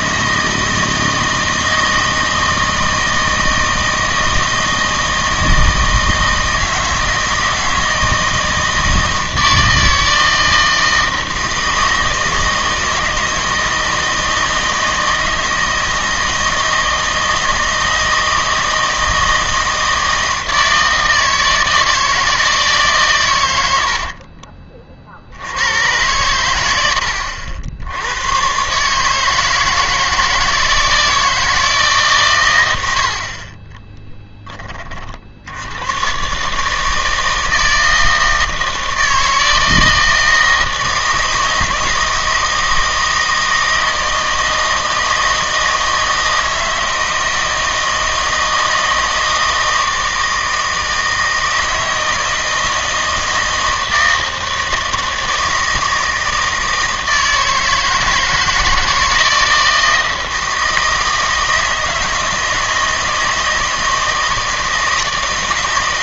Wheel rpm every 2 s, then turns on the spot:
160, 160, 160, 160, 160, 160, 160, 160, 160, 160, 160, 140, 40, 90, 140, 160, 80, 50, 160, 160, 160, 160, 160, 160, 160, 160, 160, 160, 160, 160, 160, 160, 160.
none